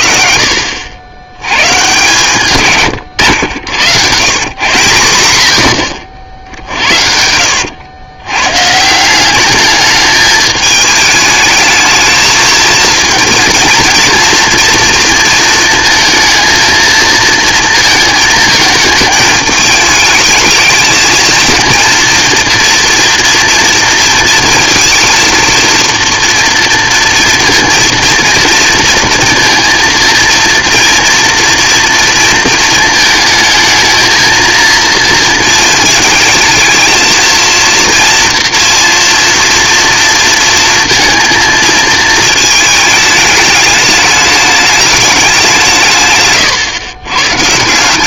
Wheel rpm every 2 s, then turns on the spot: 70, 130, 130, 60, 160, 210, 220, 230, 230, 220, 220, 230, 230, 230, 230, 230, 220, 230, 230, 230, 230, 220, 210, 110.
6-8